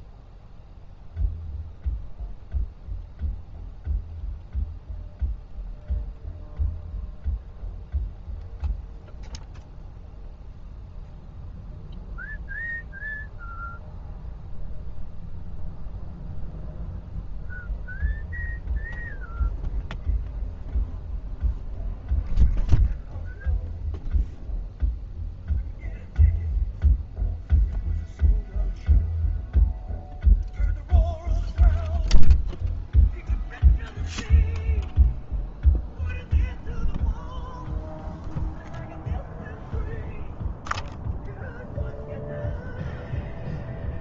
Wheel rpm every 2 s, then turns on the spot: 0, 0, 0, 0, 0, 0, 0, 0, 0, 0, 0, 0, 0, 0, 0, 0, 0, 0, 0, 0, 0, 0.
none